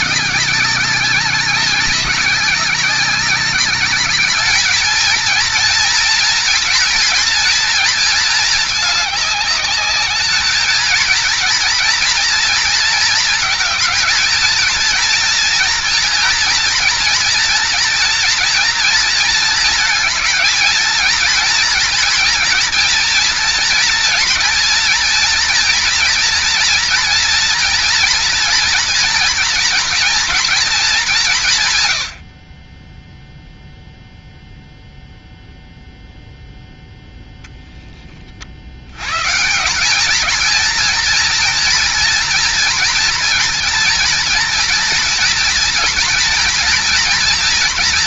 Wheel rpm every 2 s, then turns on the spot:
190, 200, 220, 230, 220, 220, 230, 230, 240, 230, 220, 230, 230, 230, 230, 230, 30, 0, 0, 70, 220, 230, 230, 230.
none